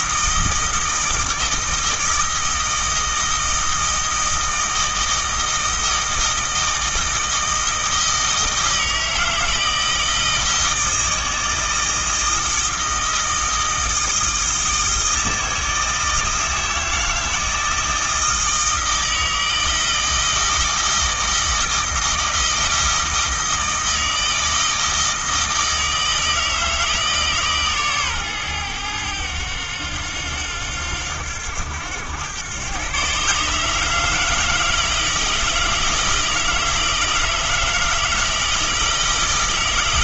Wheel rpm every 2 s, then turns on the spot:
160, 160, 160, 160, 160, 160, 160, 160, 160, 160, 160, 160, 160, 160, 110, 90, 130, 160, 160, 160.
none